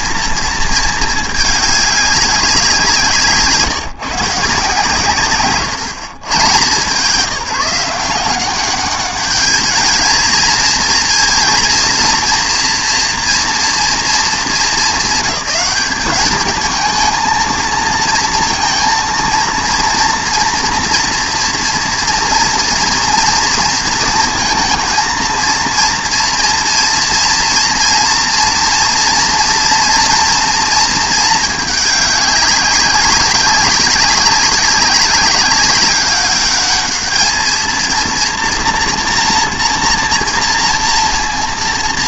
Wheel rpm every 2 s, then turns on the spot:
230, 190, 150, 130, 190, 220, 230, 210, 220, 230, 240, 230, 230, 230, 230, 230, 200, 200, 200, 230, 230.
none